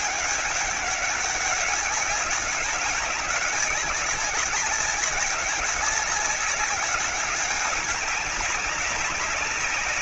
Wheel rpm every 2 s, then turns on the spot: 200, 200, 200, 190, 200.
none